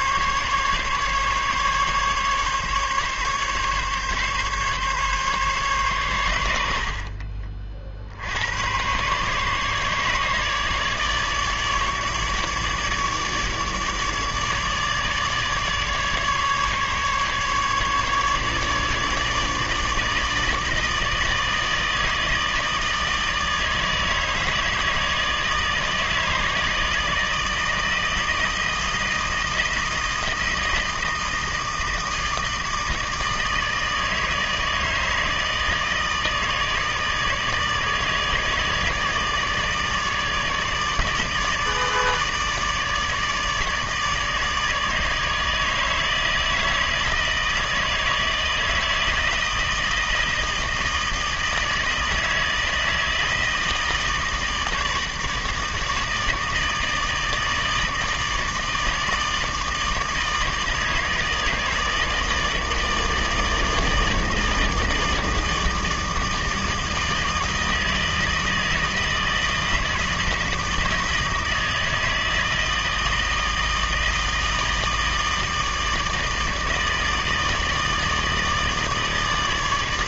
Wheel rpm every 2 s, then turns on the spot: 140, 140, 140, 80, 100, 150, 150, 150, 150, 150, 160, 160, 160, 160, 160, 160, 160, 160, 150, 160, 150, 150, 150, 160, 160, 160, 160, 160, 160, 160, 160, 160, 160, 160, 160, 160, 160, 160, 160, 160.
none